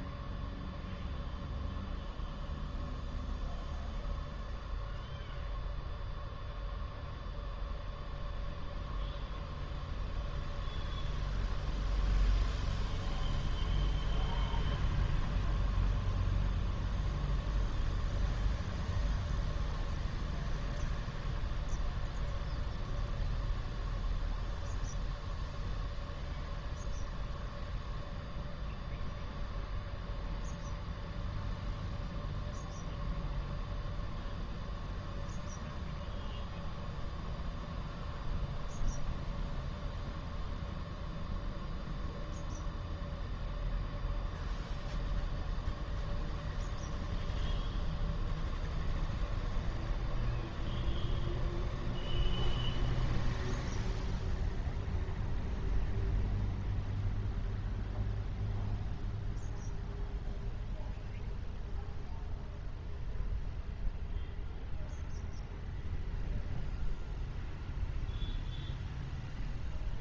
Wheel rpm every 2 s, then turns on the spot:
0, 0, 0, 0, 0, 0, 0, 0, 0, 0, 0, 0, 0, 0, 0, 0, 0, 0, 0, 0, 0, 0, 0, 0, 0, 0, 0, 0, 0, 0, 0, 0, 0, 0, 0.
none